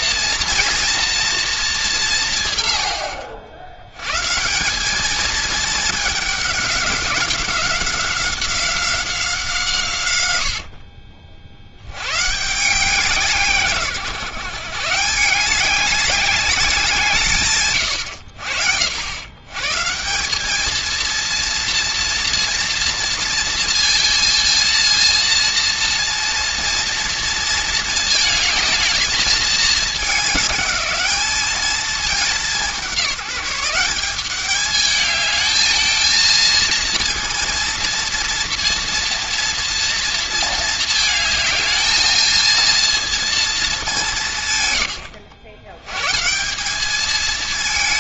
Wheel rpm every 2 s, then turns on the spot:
230, 110, 170, 200, 190, 80, 160, 150, 180, 70, 210, 230, 230, 230, 220, 210, 200, 200, 230, 230, 230, 230, 120, 190.
10-12